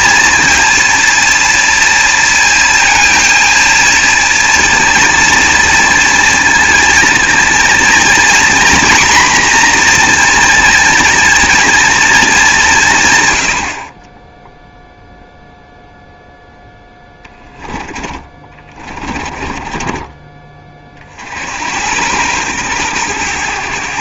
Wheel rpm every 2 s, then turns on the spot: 230, 230, 230, 230, 250, 240, 180, 0, 10, 30, 30, 110.
18-20